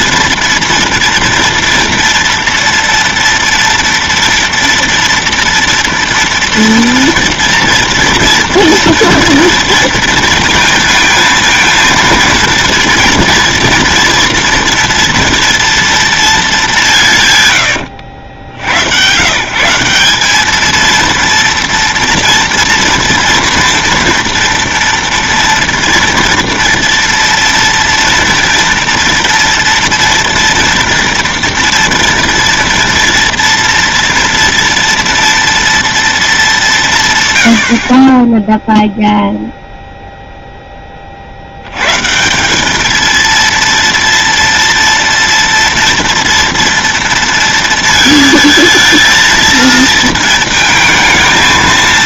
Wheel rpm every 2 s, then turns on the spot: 230, 230, 230, 230, 230, 230, 230, 230, 180, 100, 220, 230, 230, 230, 240, 240, 230, 230, 170, 0, 20, 210, 230, 230, 220, 220.
none